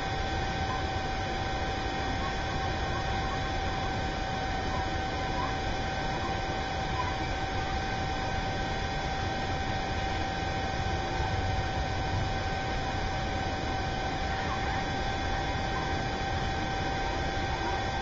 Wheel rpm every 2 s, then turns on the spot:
0, 0, 0, 0, 0, 0, 0, 0, 0.
none